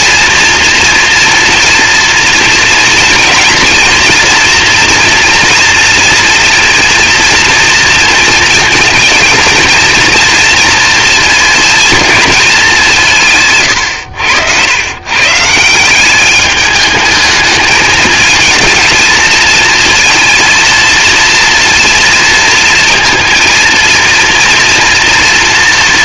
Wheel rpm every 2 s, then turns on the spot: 230, 230, 240, 230, 230, 230, 150, 150, 220, 230, 230, 230, 230.
none